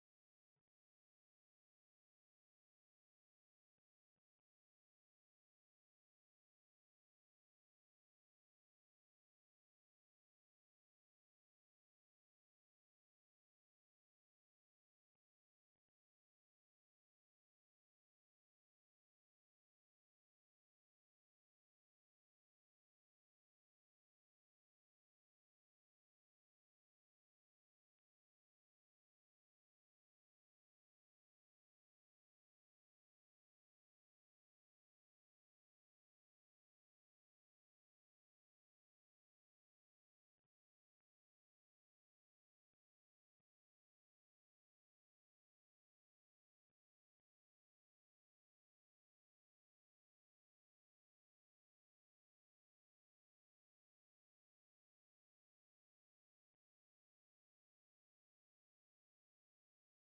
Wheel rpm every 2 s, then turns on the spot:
0, 0, 0, 0, 0, 0, 0, 0, 0, 0, 0, 0, 0, 0, 0, 0, 0, 0, 0, 0, 0, 0, 0, 0, 0, 0, 0, 0, 0, 0.
none